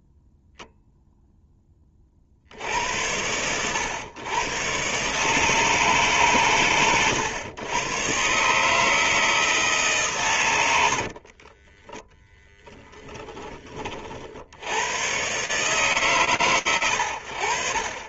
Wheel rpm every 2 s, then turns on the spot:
0, 70, 120, 130, 150, 110, 10, 70, 110.
10-12